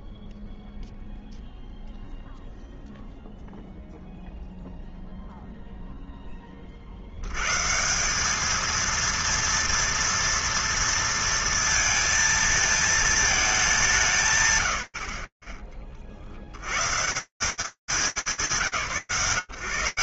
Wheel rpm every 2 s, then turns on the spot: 0, 0, 0, 10, 210, 230, 230, 150, 60, 120.
none